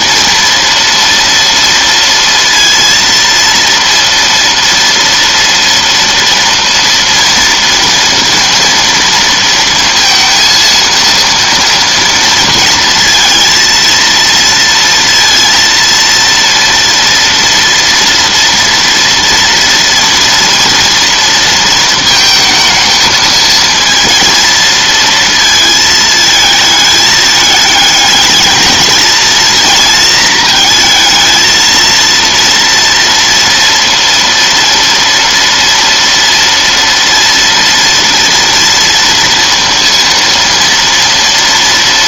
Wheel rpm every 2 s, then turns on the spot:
230, 230, 230, 230, 230, 230, 230, 230, 230, 230, 230, 220, 230, 220, 220, 230, 230, 230, 230, 230, 230.
none